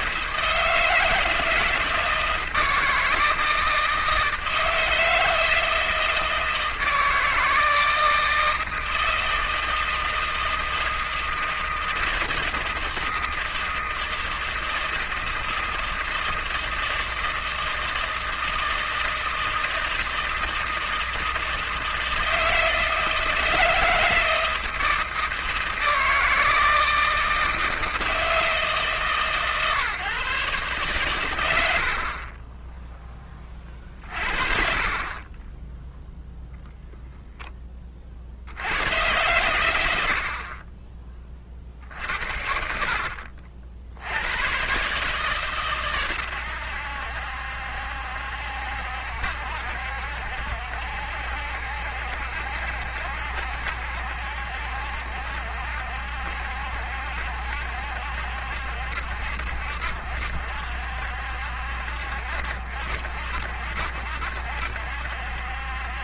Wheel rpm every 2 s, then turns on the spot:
160, 160, 160, 160, 160, 160, 160, 160, 160, 160, 160, 160, 160, 160, 160, 130, 30, 40, 0, 60, 50, 60, 100, 100, 70, 70, 70, 70, 70, 70, 70, 60, 70.
32-34 40-42